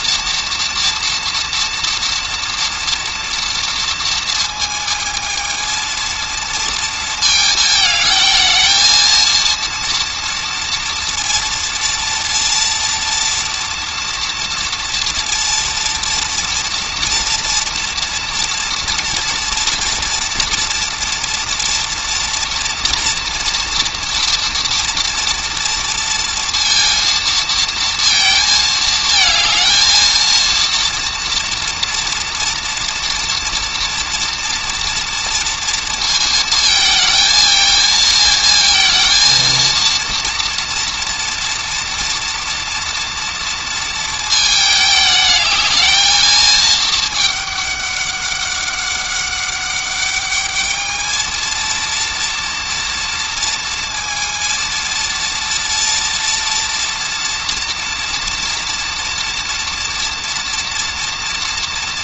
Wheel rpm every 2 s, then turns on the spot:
230, 230, 220, 230, 230, 230, 230, 230, 240, 240, 240, 230, 240, 230, 220, 230, 240, 240, 220, 230, 230, 230, 220, 220, 200, 220, 230, 230, 230, 230, 230.
none